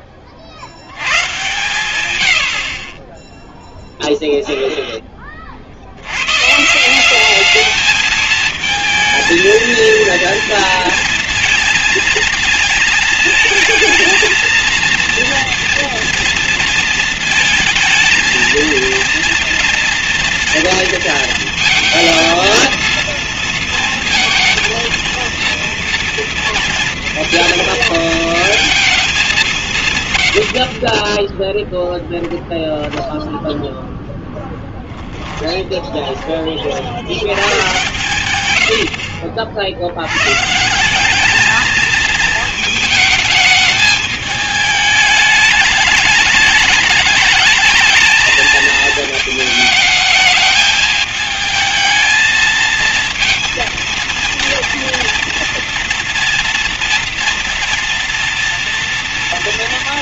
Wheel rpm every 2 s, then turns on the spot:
80, 30, 10, 170, 230, 230, 220, 230, 230, 230, 230, 230, 230, 230, 220, 30, 20, 10, 90, 80, 190, 220, 220, 210, 220, 220, 220, 230, 230, 230.
34-36